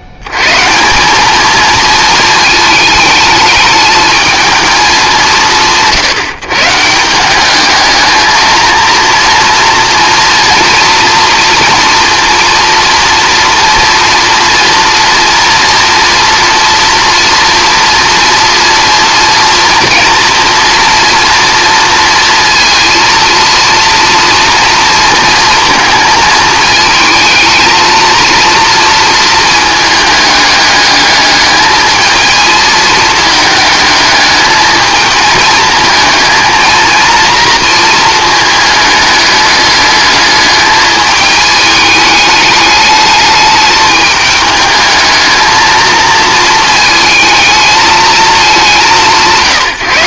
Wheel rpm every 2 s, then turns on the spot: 90, 220, 220, 150, 220, 230, 240, 230, 230, 230, 240, 230, 230, 220, 230, 210, 220, 220, 220, 220, 210, 210, 210, 230, 200.
none